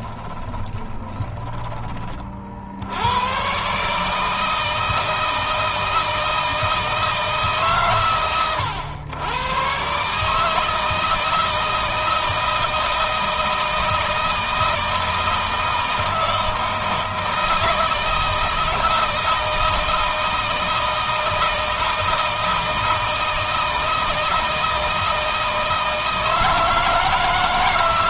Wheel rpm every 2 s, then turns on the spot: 20, 50, 160, 160, 110, 150, 160, 160, 160, 160, 160, 160, 160, 160.
0-2